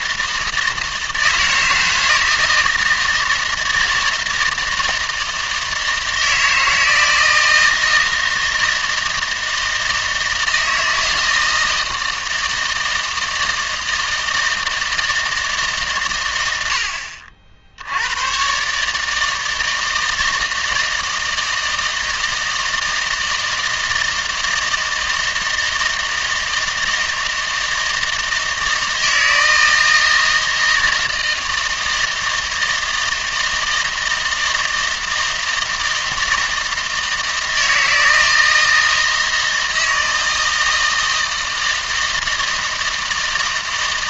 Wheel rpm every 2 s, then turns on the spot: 160, 160, 160, 160, 160, 160, 160, 160, 90, 140, 160, 160, 160, 160, 160, 160, 160, 160, 160, 160, 160, 160.
none